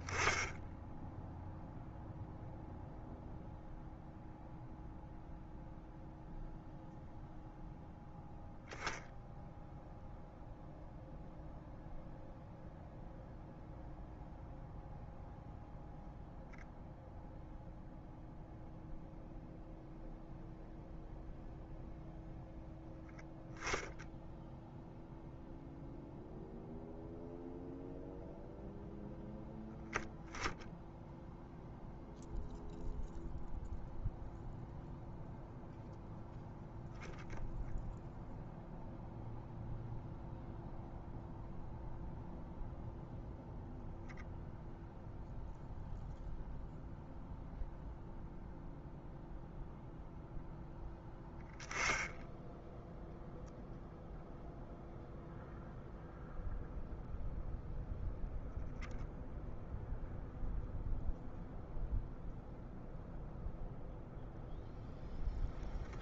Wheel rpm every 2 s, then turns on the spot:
10, 0, 0, 0, 0, 0, 0, 0, 0, 0, 0, 0, 0, 0, 0, 0, 0, 0, 0, 0, 0, 0, 0, 0, 0, 0, 0, 0, 0, 10, 0, 0, 0.
none